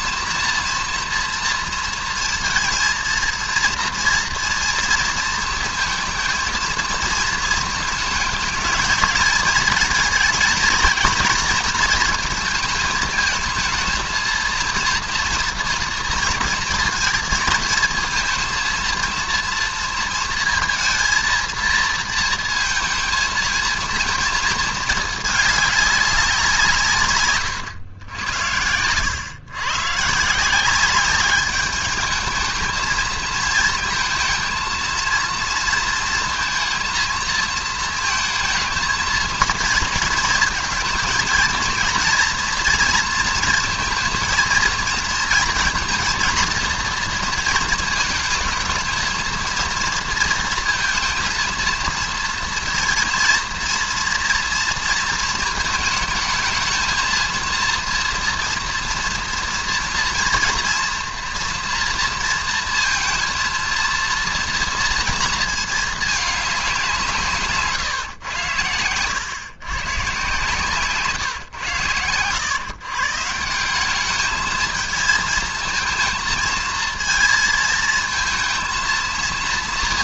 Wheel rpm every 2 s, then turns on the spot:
230, 230, 230, 230, 220, 230, 220, 230, 230, 230, 230, 230, 220, 170, 90, 170, 220, 230, 230, 230, 220, 230, 230, 230, 220, 230, 230, 230, 220, 240, 230, 230, 230, 200, 110, 140, 120, 220, 220, 230.
none